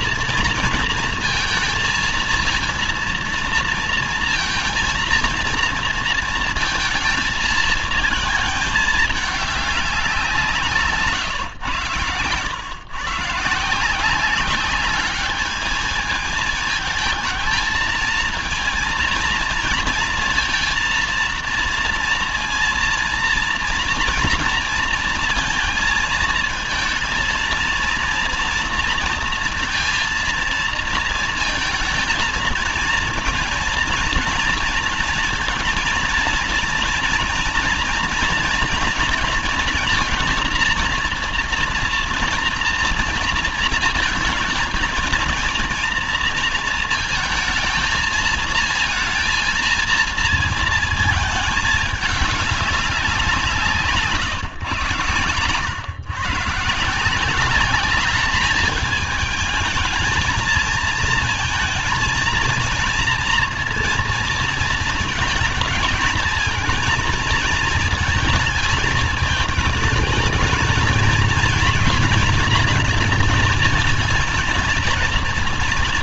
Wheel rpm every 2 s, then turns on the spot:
230, 230, 230, 220, 210, 150, 150, 200, 220, 230, 230, 230, 230, 220, 230, 220, 220, 230, 230, 230, 230, 230, 220, 230, 230, 220, 190, 120, 170, 220, 220, 230, 230, 220, 220, 230, 240, 240.
none